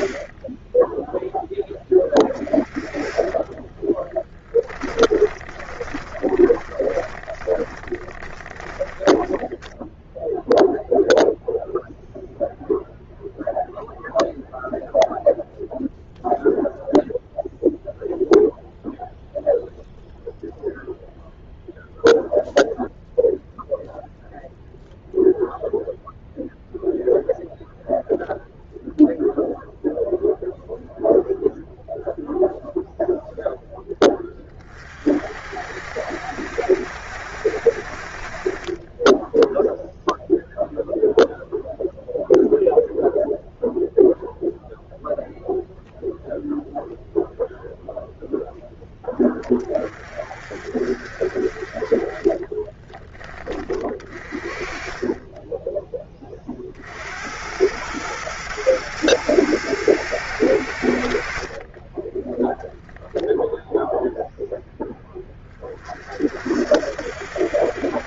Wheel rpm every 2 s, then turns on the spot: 20, 30, 10, 20, 20, 0, 0, 0, 0, 0, 0, 0, 0, 0, 0, 0, 0, 30, 70, 30, 0, 0, 0, 0, 0, 40, 20, 30, 40, 110, 90, 10, 0, 60.
4-10 52-54